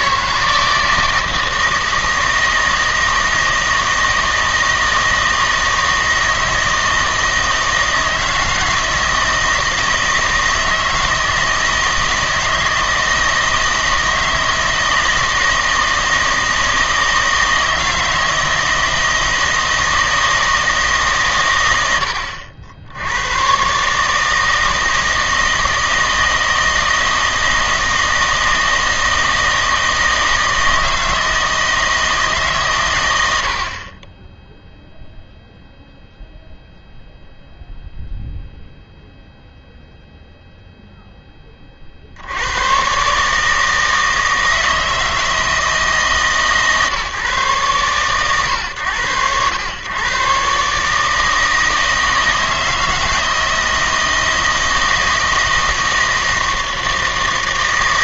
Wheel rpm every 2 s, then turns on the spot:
160, 160, 160, 160, 160, 160, 160, 160, 160, 160, 160, 80, 160, 160, 160, 160, 120, 0, 0, 0, 0, 110, 160, 140, 110, 140, 160, 160, 160.
none